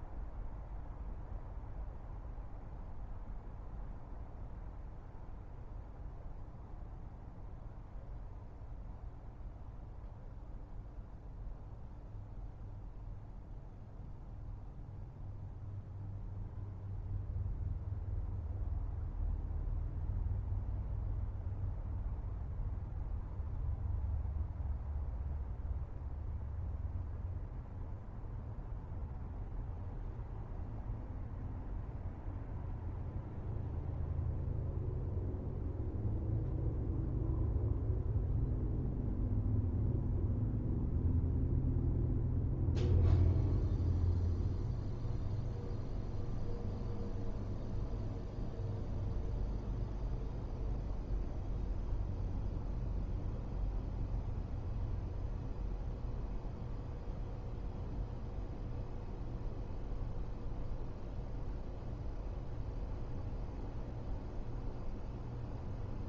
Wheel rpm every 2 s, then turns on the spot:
0, 0, 0, 0, 0, 0, 0, 0, 0, 0, 0, 0, 0, 0, 0, 0, 0, 0, 0, 0, 0, 0, 0, 0, 0, 0, 0, 0, 0, 0, 0, 0, 0.
none